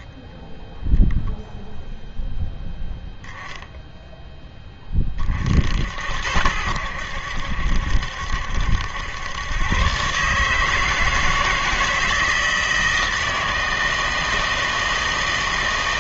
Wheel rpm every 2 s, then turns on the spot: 10, 0, 10, 80, 70, 150, 160, 160.
none